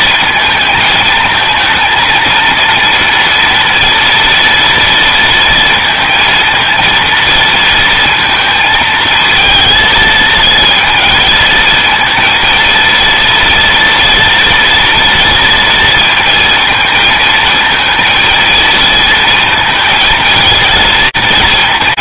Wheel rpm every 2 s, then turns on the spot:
220, 230, 230, 230, 220, 230, 230, 240, 230, 220, 230.
none